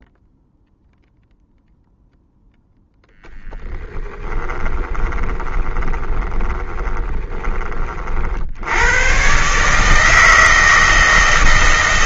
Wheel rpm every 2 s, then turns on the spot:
0, 0, 10, 20, 80, 160.
4-8